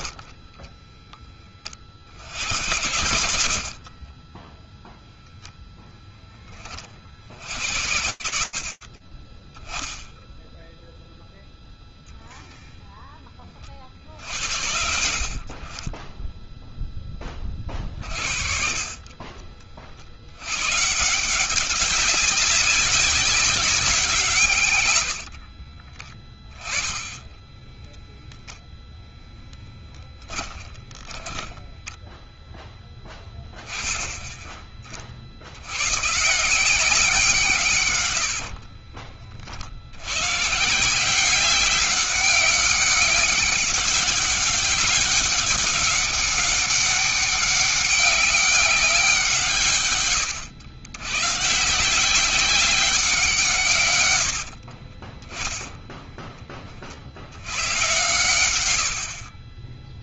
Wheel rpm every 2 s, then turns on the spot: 10, 100, 0, 20, 70, 10, 10, 50, 20, 40, 180, 200, 60, 10, 0, 10, 10, 60, 170, 50, 190, 200, 200, 200, 180, 130, 170, 10, 100, 30.
2-4 24-28 30-32 58-60